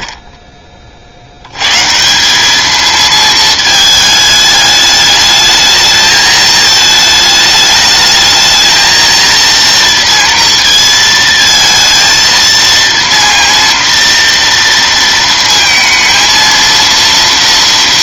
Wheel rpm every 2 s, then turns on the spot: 0, 180, 210, 220, 220, 230, 230, 230, 230.
none